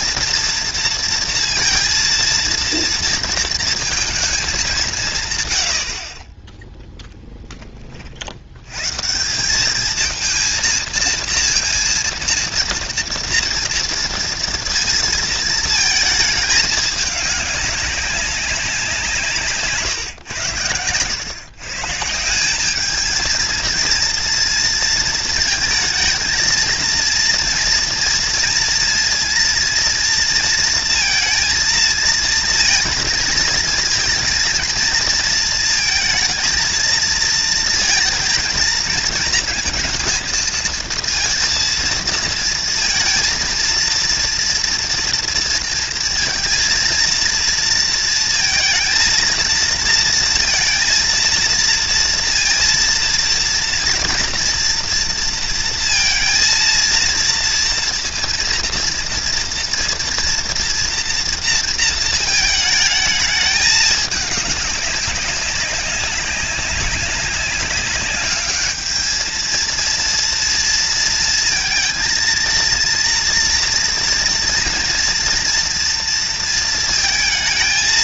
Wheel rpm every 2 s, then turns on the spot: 230, 230, 150, 0, 140, 230, 240, 230, 210, 180, 110, 220, 230, 230, 230, 230, 220, 230, 220, 230, 230, 230, 230, 230, 230, 230, 230, 230, 230, 230, 240, 210, 190, 200, 210, 230, 230, 230, 230.
none